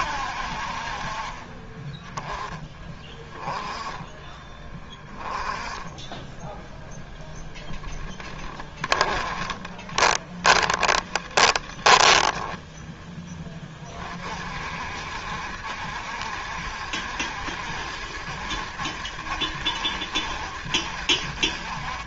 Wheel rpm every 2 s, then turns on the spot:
50, 10, 10, 0, 20, 20, 10, 60, 70, 60, 70.
8-12